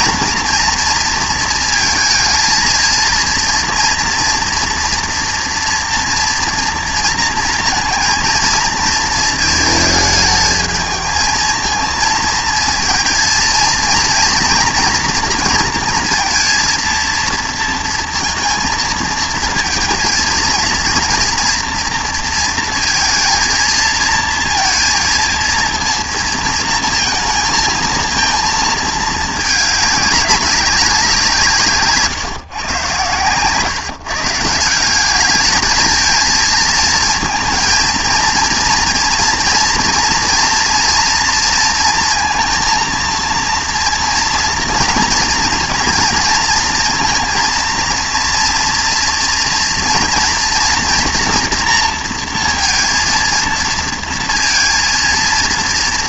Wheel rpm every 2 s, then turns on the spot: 230, 220, 230, 230, 230, 220, 230, 230, 230, 230, 230, 230, 230, 230, 220, 200, 130, 170, 220, 240, 230, 230, 230, 230, 230, 240, 230, 230.
none